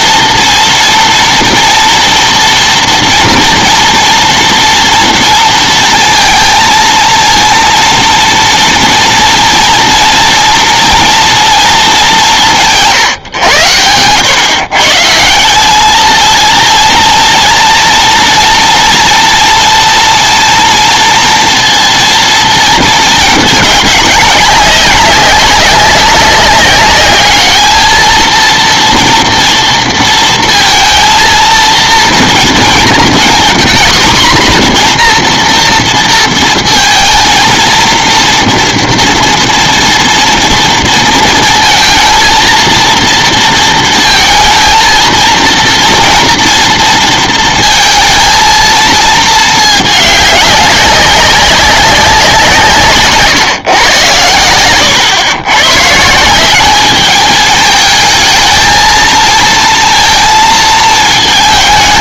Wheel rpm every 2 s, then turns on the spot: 230, 240, 230, 220, 230, 230, 170, 130, 230, 230, 230, 230, 190, 200, 230, 230, 230, 240, 230, 230, 230, 230, 230, 230, 230, 200, 170, 110, 200, 220, 220.
none